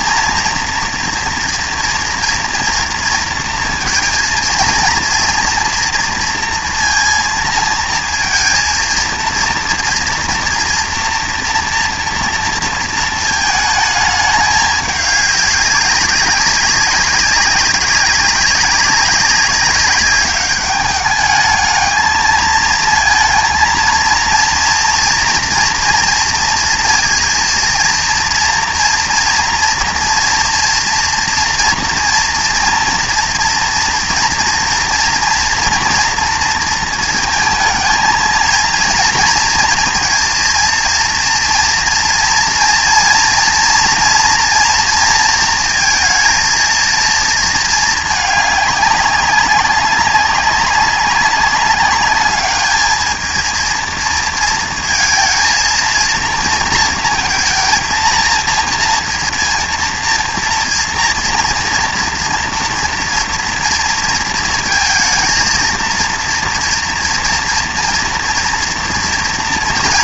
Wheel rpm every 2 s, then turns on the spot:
230, 230, 230, 230, 230, 240, 230, 210, 200, 200, 200, 220, 230, 230, 230, 240, 230, 230, 230, 230, 230, 230, 240, 230, 200, 200, 210, 230, 230, 230, 230, 230, 230, 230, 230.
none